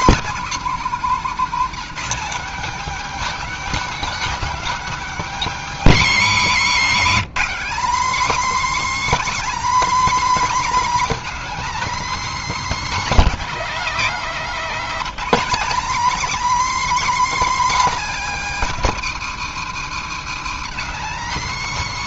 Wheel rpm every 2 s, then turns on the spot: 250, 240, 270, 190, 300, 280, 290, 230, 270, 230, 220.
6-8